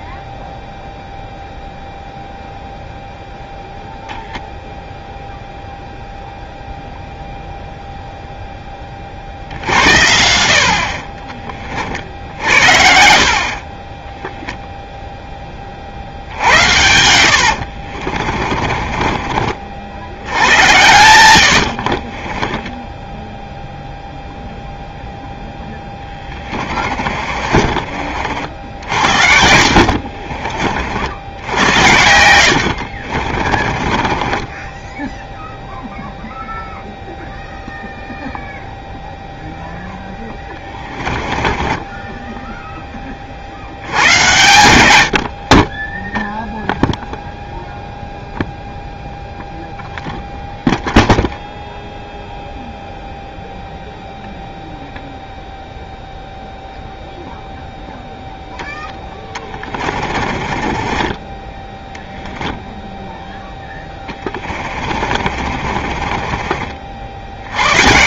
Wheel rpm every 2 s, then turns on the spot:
0, 0, 0, 0, 10, 50, 60, 0, 80, 30, 100, 20, 0, 30, 60, 50, 70, 10, 0, 0, 20, 10, 100, 0, 0, 0, 0, 0, 0, 0, 30, 0, 40, 40.
16-20 22-24 26-28 32-34 40-42 60-62 64-66